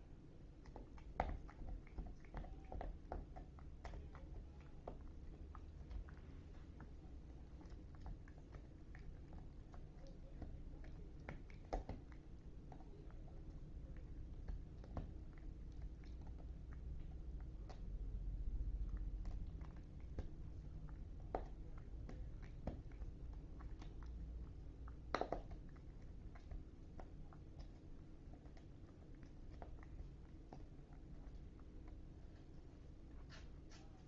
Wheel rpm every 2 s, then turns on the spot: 0, 0, 0, 0, 0, 0, 0, 0, 0, 0, 0, 0, 0, 0, 0, 0, 0.
none